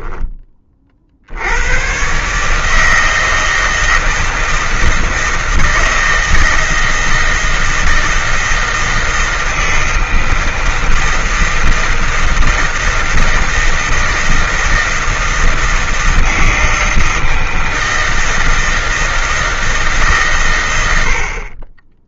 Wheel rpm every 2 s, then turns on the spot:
30, 150, 160, 160, 160, 160, 160, 160, 160, 160, 130.
none